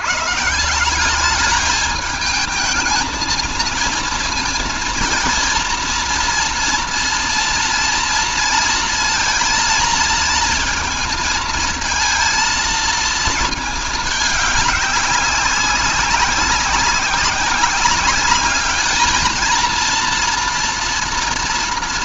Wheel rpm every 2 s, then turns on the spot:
160, 220, 230, 230, 230, 230, 230, 200, 190, 210, 230.
none